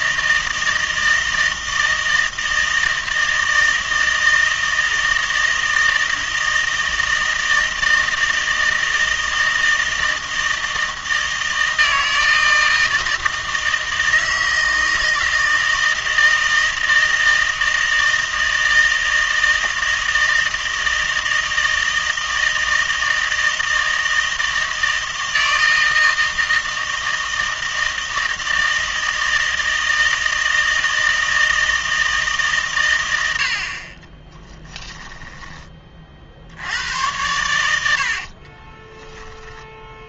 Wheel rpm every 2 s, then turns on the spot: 160, 160, 160, 160, 160, 160, 160, 160, 160, 160, 160, 160, 160, 160, 160, 160, 130, 10, 80, 20.
34-36 38-40